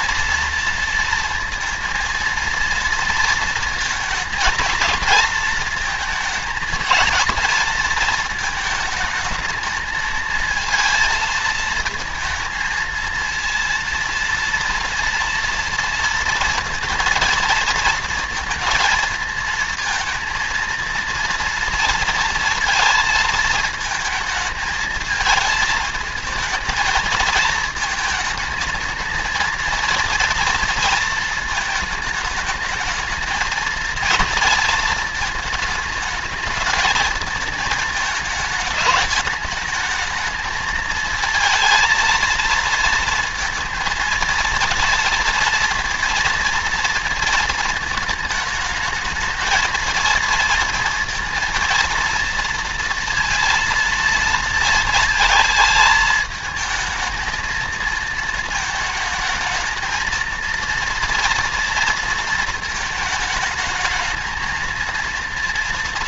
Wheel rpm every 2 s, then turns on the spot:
230, 230, 230, 220, 220, 220, 220, 230, 230, 230, 230, 230, 220, 220, 220, 230, 220, 230, 220, 220, 220, 230, 230, 230, 220, 230, 230, 220, 220, 220, 230, 230, 220.
none